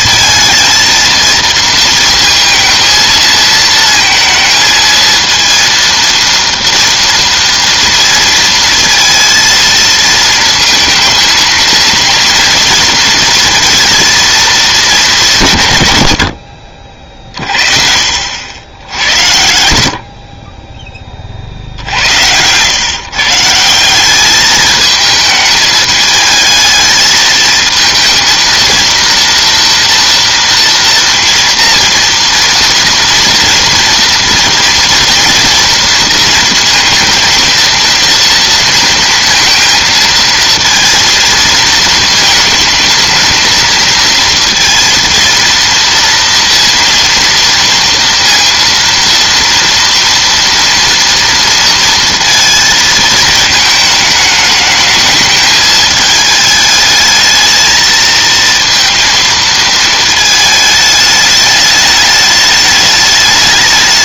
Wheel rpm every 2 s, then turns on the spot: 220, 220, 220, 230, 230, 220, 230, 230, 70, 60, 20, 100, 210, 220, 230, 230, 230, 230, 230, 230, 220, 230, 230, 230, 230, 230, 230, 220, 220, 230, 220, 210.
none